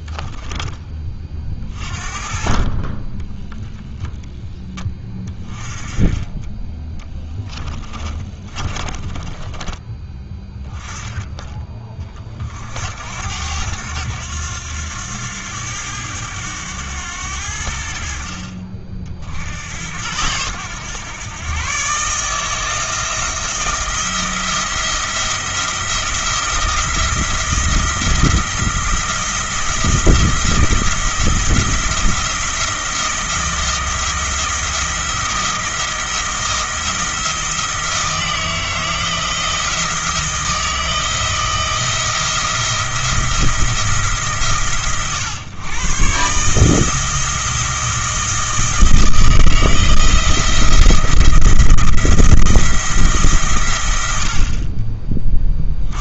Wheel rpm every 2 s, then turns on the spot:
20, 30, 10, 20, 20, 10, 60, 90, 100, 50, 110, 160, 170, 170, 170, 170, 170, 170, 160, 160, 170, 170, 130, 160, 160, 170, 170, 40.
8-10